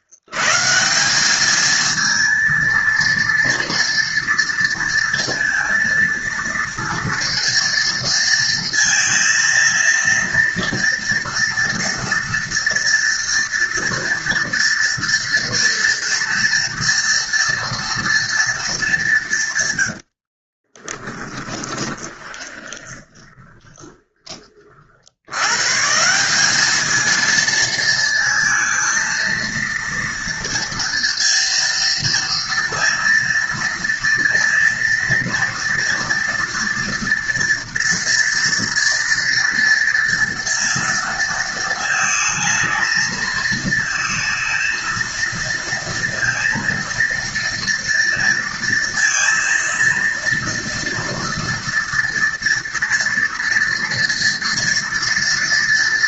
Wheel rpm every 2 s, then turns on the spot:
110, 230, 230, 230, 230, 230, 230, 230, 230, 230, 60, 20, 30, 190, 220, 230, 230, 230, 230, 230, 230, 220, 220, 230, 230, 230, 230, 230.
20-24